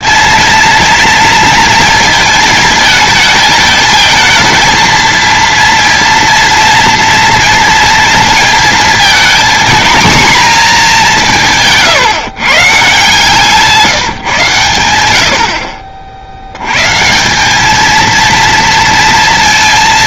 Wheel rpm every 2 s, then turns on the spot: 230, 220, 230, 230, 230, 180, 160, 100, 160, 230.
none